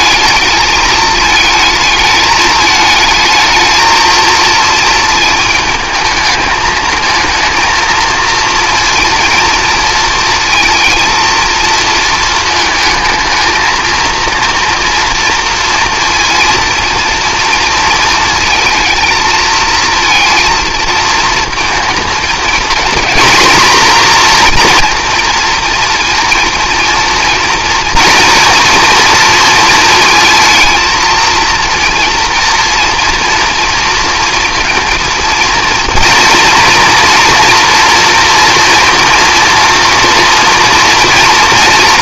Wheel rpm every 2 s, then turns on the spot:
210, 220, 220, 220, 230, 230, 220, 240, 230, 220, 230, 240, 240, 230, 230, 220, 230, 230, 240, 230, 230.
none